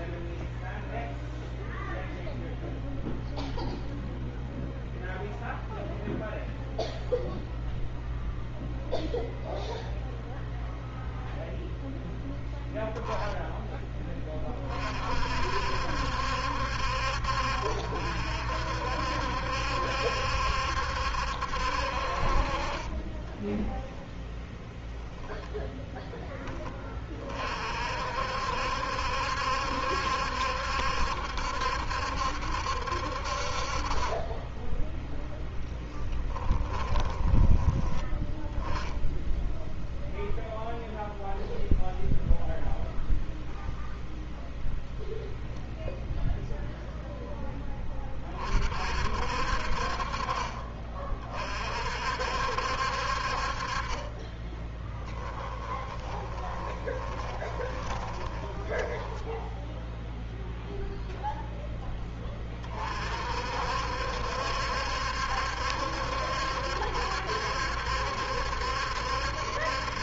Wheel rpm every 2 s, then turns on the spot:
0, 0, 0, 0, 0, 0, 0, 30, 60, 60, 70, 30, 10, 30, 70, 70, 60, 10, 20, 10, 0, 0, 0, 0, 50, 30, 60, 10, 20, 10, 0, 40, 70, 70, 70.
36-38 54-60